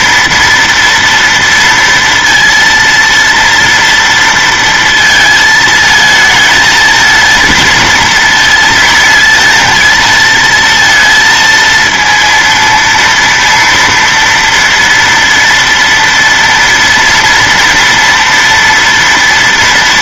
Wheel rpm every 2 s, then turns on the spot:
230, 230, 230, 220, 230, 230, 230, 230, 230, 230.
none